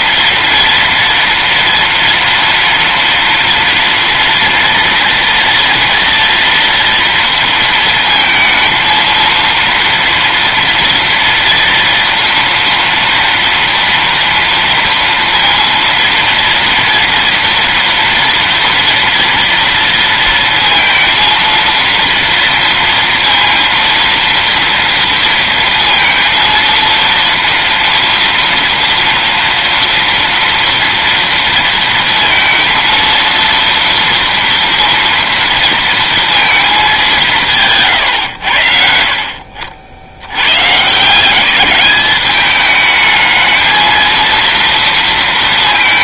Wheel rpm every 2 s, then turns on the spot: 230, 240, 230, 230, 230, 240, 230, 230, 230, 230, 230, 230, 230, 230, 230, 230, 230, 230, 210, 70, 130, 210, 230.
38-40